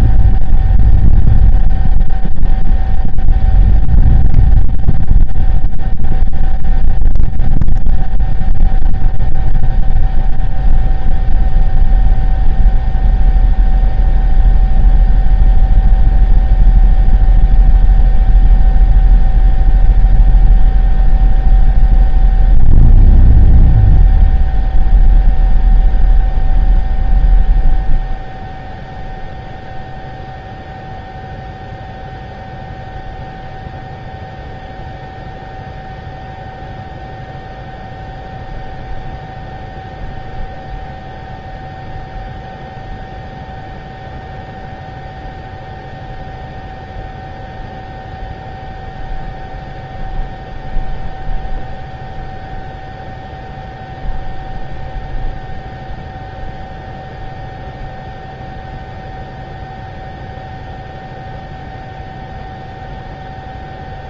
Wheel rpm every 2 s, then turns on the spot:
0, 0, 0, 0, 0, 0, 0, 0, 0, 0, 0, 0, 0, 0, 0, 0, 0, 0, 0, 0, 0, 0, 0, 0, 0, 0, 0, 0, 0, 0, 0, 0.
none